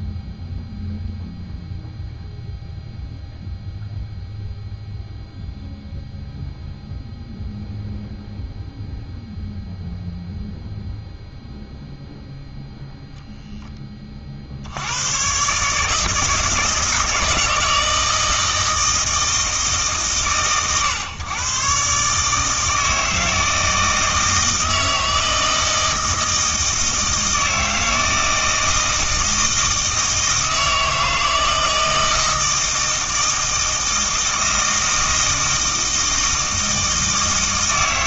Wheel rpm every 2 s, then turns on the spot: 0, 0, 0, 0, 0, 0, 0, 90, 160, 160, 130, 160, 160, 160, 160, 160, 160, 160, 160.
none